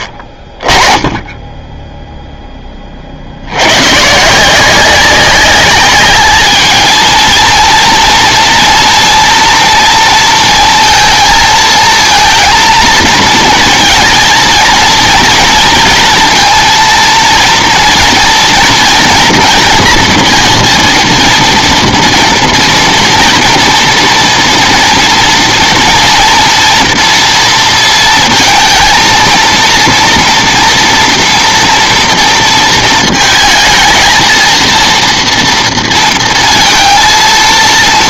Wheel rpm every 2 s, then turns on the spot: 30, 10, 170, 220, 240, 230, 230, 230, 230, 240, 230, 230, 230, 230, 230, 230, 230, 230, 230.
none